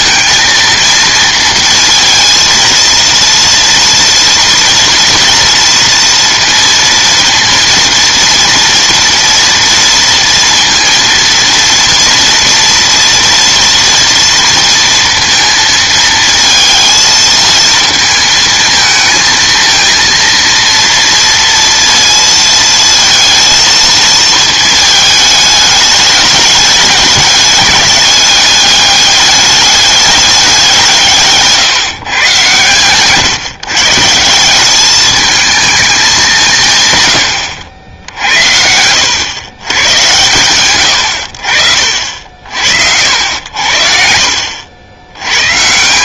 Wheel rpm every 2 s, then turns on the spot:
230, 230, 230, 230, 230, 230, 230, 230, 220, 220, 230, 230, 220, 210, 210, 170, 130, 200, 130, 90, 100, 70, 90.
40-42